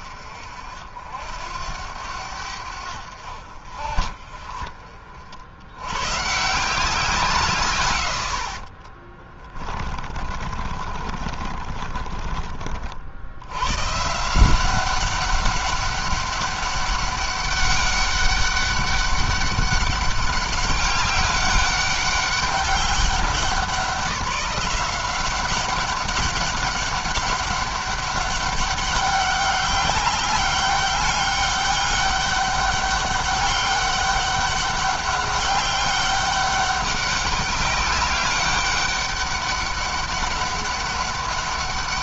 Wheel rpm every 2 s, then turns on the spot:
70, 80, 40, 150, 50, 30, 40, 180, 200, 200, 200, 200, 180, 200, 200, 200, 200, 200, 200, 200, 200.
8-12